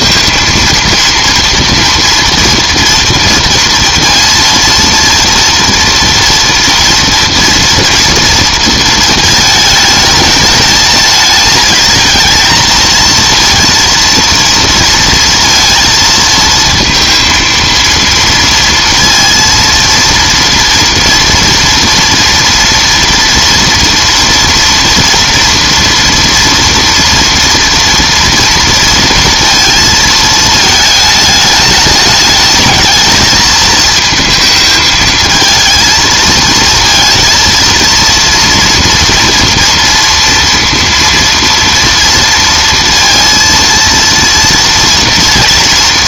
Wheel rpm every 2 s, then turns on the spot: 230, 230, 230, 230, 230, 210, 230, 230, 220, 230, 230, 230, 230, 230, 230, 220, 210, 220, 230, 240, 230, 230, 230.
none